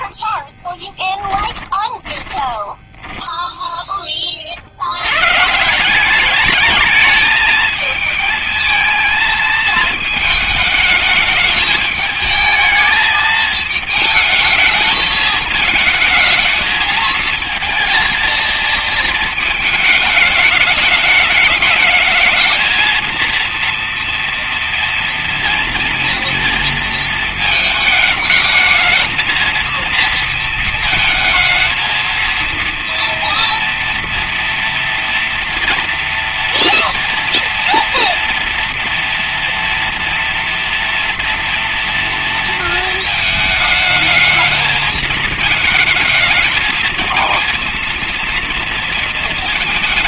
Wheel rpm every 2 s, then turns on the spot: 20, 20, 50, 210, 220, 210, 220, 220, 220, 230, 210, 220, 230, 230, 220, 230, 230, 230, 230, 230, 230, 230, 220, 220, 230.
0-4